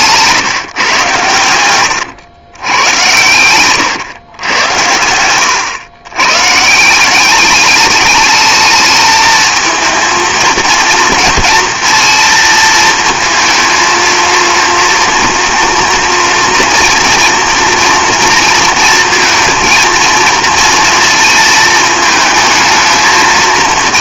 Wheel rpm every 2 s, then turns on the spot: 150, 110, 100, 140, 220, 230, 220, 230, 230, 230, 230, 220.
none